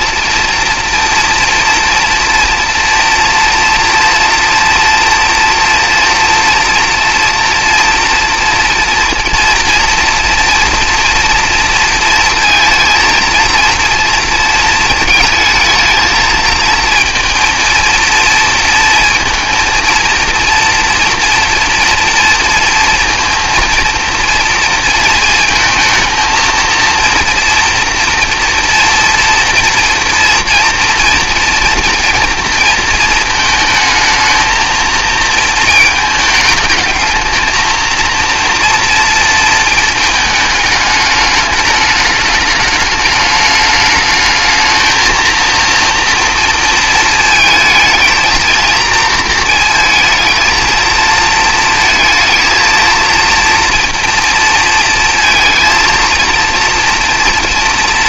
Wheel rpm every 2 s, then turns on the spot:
230, 230, 230, 230, 240, 230, 230, 230, 220, 230, 230, 230, 230, 230, 230, 230, 220, 220, 220, 230, 220, 210, 220, 230, 230, 220, 230, 230, 230.
none